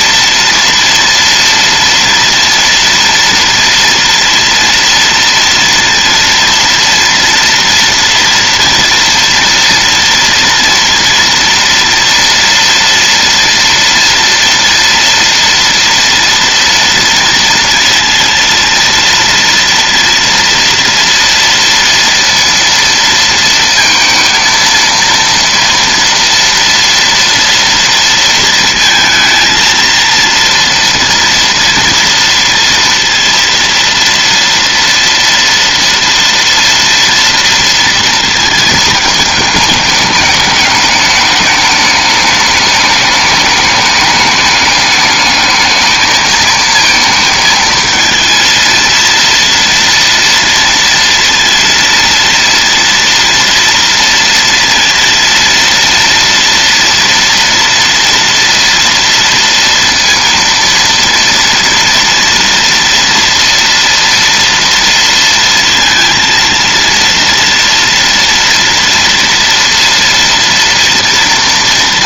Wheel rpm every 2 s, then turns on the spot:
230, 230, 230, 230, 230, 230, 230, 240, 230, 230, 230, 230, 230, 230, 230, 230, 230, 230, 230, 220, 210, 210, 210, 220, 230, 230, 230, 230, 230, 230, 230, 230, 230, 230, 230, 230.
none